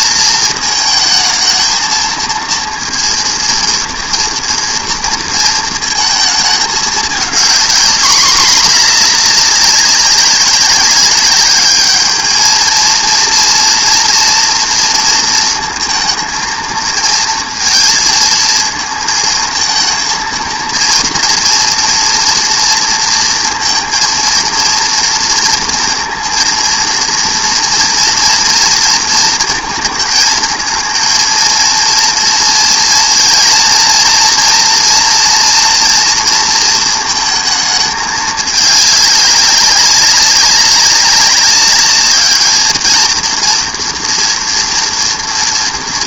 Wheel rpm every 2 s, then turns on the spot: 230, 230, 230, 220, 220, 200, 220, 230, 220, 220, 230, 230, 230, 230, 230, 220, 230, 230, 230, 210, 190, 220, 230.
none